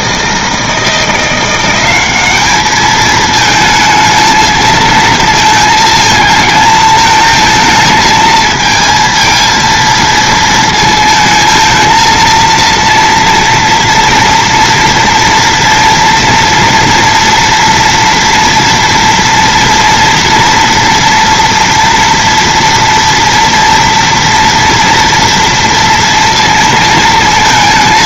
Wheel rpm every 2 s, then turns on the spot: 210, 220, 220, 230, 230, 230, 230, 230, 230, 230, 230, 230, 230, 230.
none